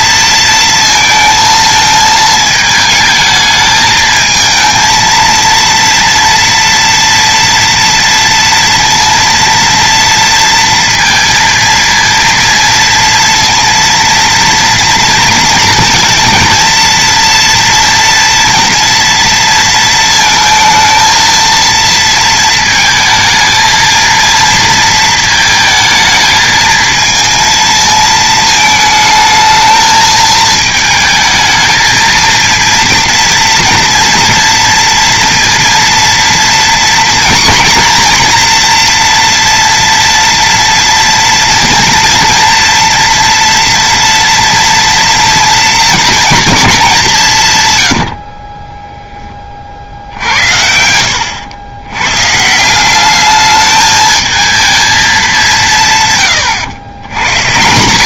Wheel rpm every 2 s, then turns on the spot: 230, 220, 220, 230, 230, 230, 230, 230, 230, 230, 230, 220, 230, 220, 220, 220, 230, 230, 240, 240, 230, 240, 230, 200, 20, 70, 190, 220, 100.
none